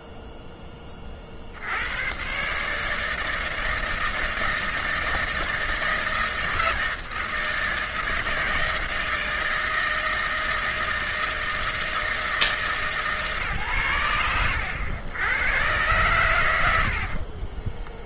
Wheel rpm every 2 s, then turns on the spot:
10, 140, 160, 160, 160, 160, 160, 80, 90.
none